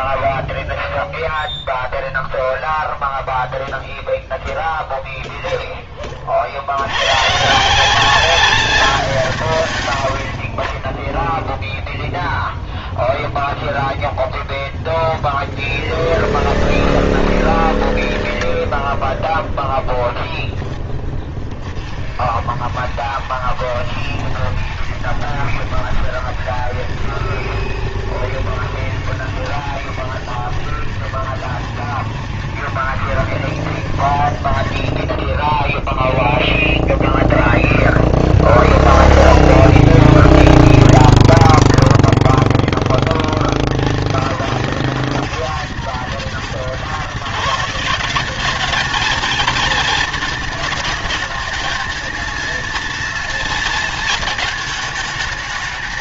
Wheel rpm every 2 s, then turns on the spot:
0, 0, 0, 90, 180, 20, 0, 0, 10, 10, 10, 60, 70, 70, 70, 60, 70, 30, 0, 0, 0, 10, 100, 130, 220, 220, 230, 220.
16-18